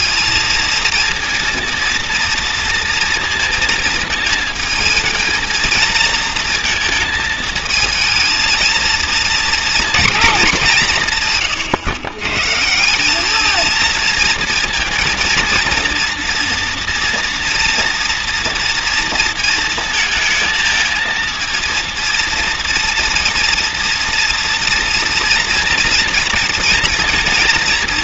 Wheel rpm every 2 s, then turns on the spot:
230, 230, 220, 230, 220, 190, 160, 230, 230, 230, 220, 230, 230, 230.
none